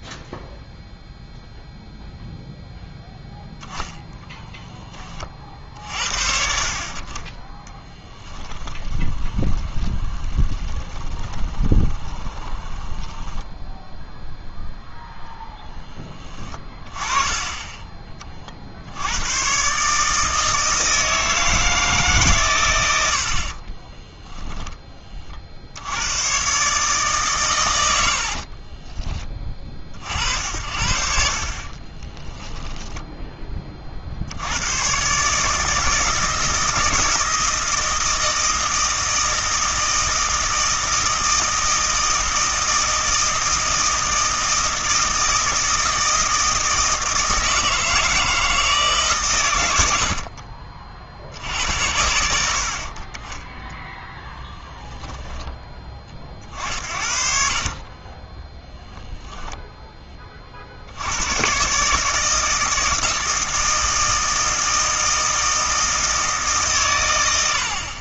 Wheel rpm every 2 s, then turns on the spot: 0, 0, 10, 60, 10, 20, 10, 0, 20, 60, 160, 100, 10, 140, 30, 60, 10, 110, 160, 160, 160, 160, 160, 160, 150, 30, 50, 10, 60, 0, 50, 160, 160, 130.
8-14 28-30 32-34